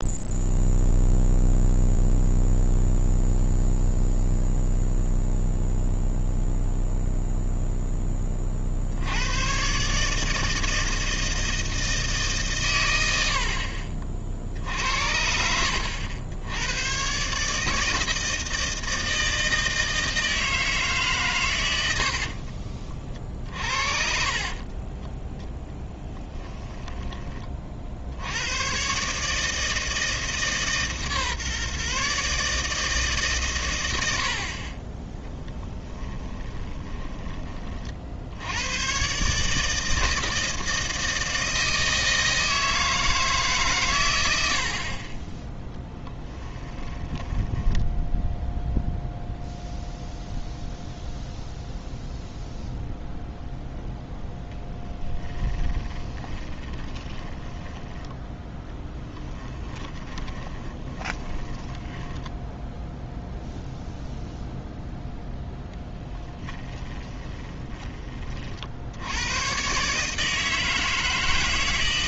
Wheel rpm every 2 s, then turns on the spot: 0, 0, 0, 0, 70, 160, 100, 70, 110, 160, 150, 50, 20, 10, 140, 150, 150, 20, 20, 120, 160, 160, 40, 10, 0, 0, 0, 10, 20, 10, 20, 0, 0, 20, 70, 160.
22-26 36-38 46-48 54-62 66-68